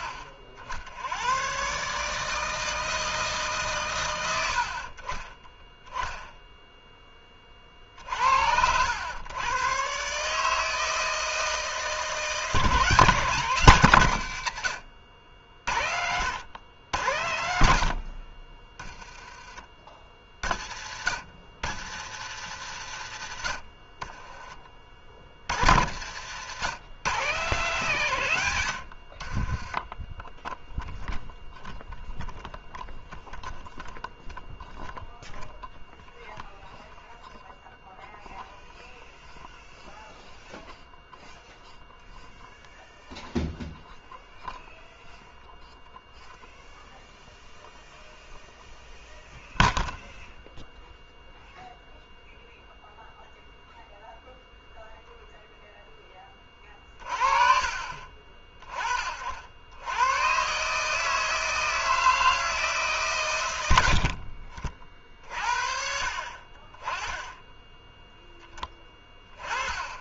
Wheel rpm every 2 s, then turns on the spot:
60, 160, 50, 0, 90, 160, 160, 80, 110, 20, 60, 80, 30, 130, 110, 0, 0, 0, 0, 0, 0, 0, 0, 0, 0, 0, 0, 0, 40, 30, 140, 150, 50, 30, 10.
18-20 26-28